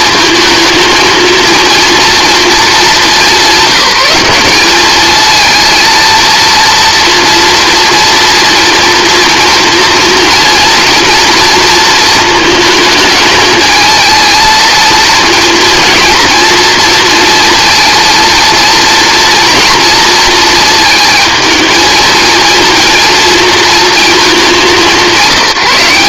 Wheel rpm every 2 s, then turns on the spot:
220, 220, 200, 230, 230, 240, 220, 230, 230, 230, 230, 230, 200.
none